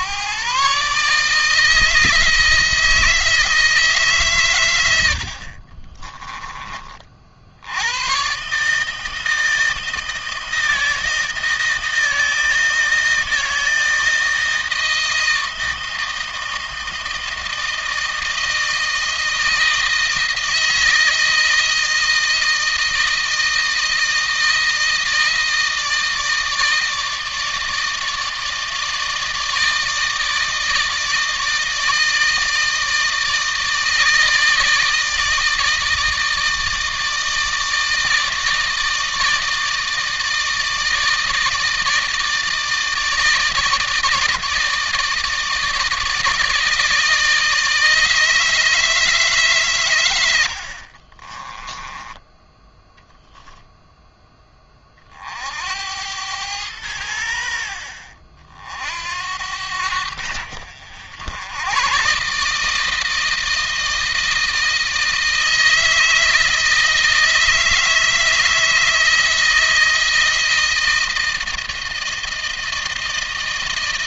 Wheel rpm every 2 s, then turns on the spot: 140, 160, 130, 20, 140, 160, 160, 160, 160, 160, 160, 160, 160, 160, 160, 160, 160, 160, 160, 160, 160, 160, 160, 160, 160, 80, 10, 20, 100, 60, 70, 150, 160, 160, 160, 160, 160.
50-52